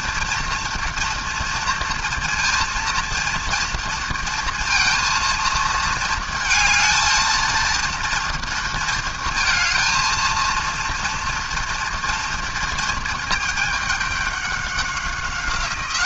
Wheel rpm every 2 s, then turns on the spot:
230, 230, 230, 230, 230, 230, 230, 190.
none